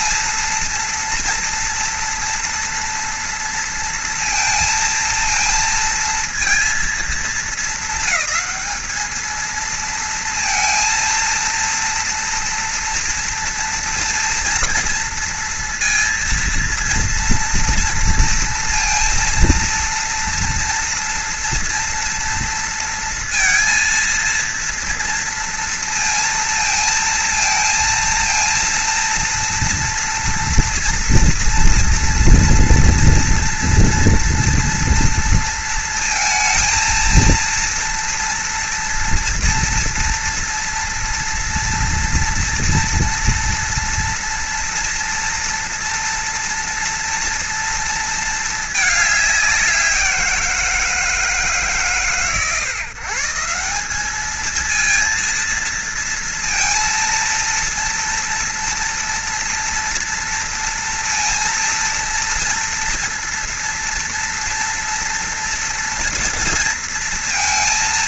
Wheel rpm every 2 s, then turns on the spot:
230, 230, 230, 230, 220, 230, 230, 230, 230, 230, 230, 230, 230, 230, 230, 230, 230, 230, 230, 230, 230, 230, 240, 230, 220, 170, 120, 220, 230, 240, 230, 230, 230, 230.
none